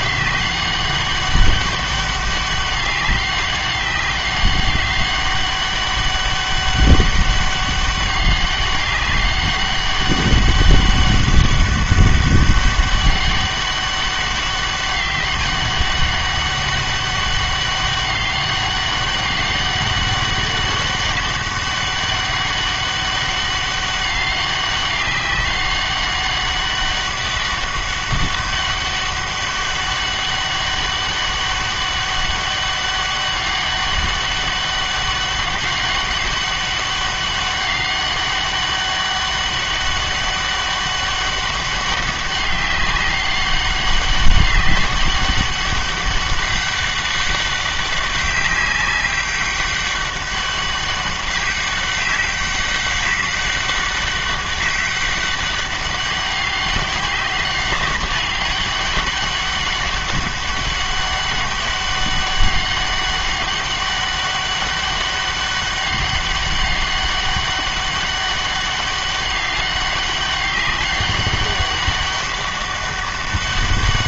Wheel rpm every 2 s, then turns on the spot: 200, 200, 200, 200, 200, 200, 200, 200, 200, 200, 200, 200, 200, 200, 200, 200, 200, 200, 200, 200, 200, 190, 200, 200, 200, 200, 200, 200, 190, 200, 200, 200, 200, 200, 200, 200, 200.
none